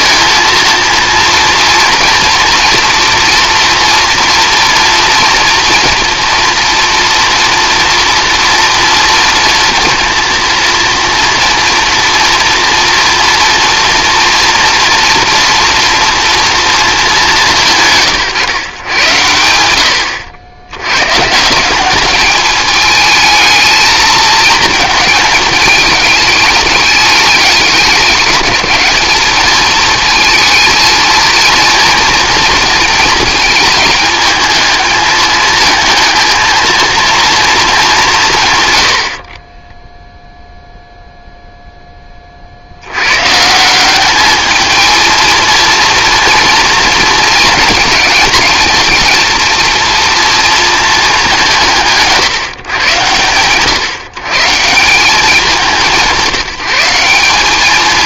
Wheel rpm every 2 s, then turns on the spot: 230, 240, 230, 230, 230, 230, 230, 230, 230, 120, 100, 210, 220, 210, 210, 230, 230, 220, 230, 120, 0, 70, 220, 230, 230, 220, 140, 150, 190.
none